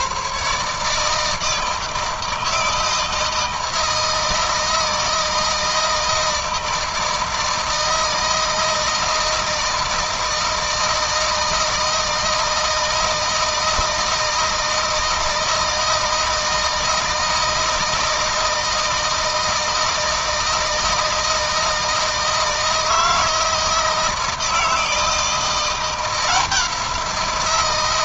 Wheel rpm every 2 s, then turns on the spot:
150, 160, 160, 160, 160, 160, 160, 160, 160, 160, 160, 160, 160, 170.
none